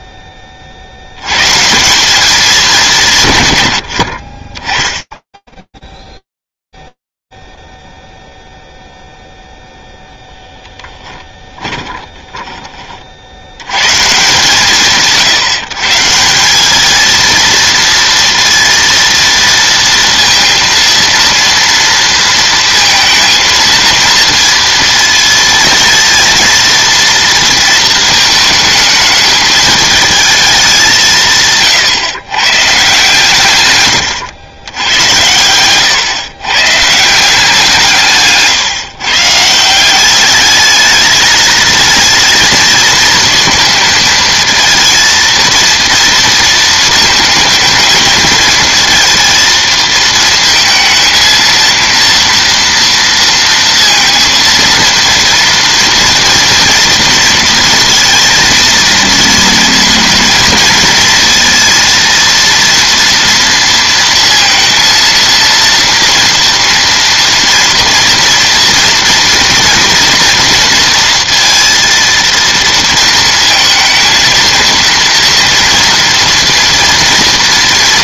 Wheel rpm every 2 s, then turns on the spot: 20, 200, 40, 0, 0, 10, 60, 150, 220, 230, 230, 230, 230, 230, 220, 170, 140, 90, 170, 150, 220, 230, 230, 220, 230, 220, 230, 230, 230, 230, 230, 230, 230, 230, 230, 230, 230, 230, 230.
10-12 34-36